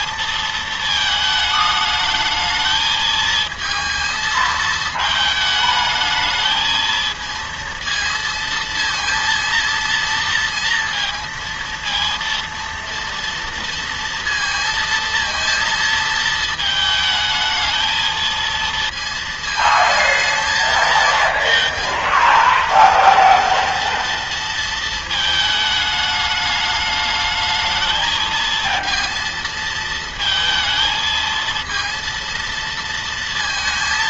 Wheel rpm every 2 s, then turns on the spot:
230, 220, 220, 220, 230, 230, 230, 230, 220, 230, 220, 230, 230, 210, 220, 220, 230.
none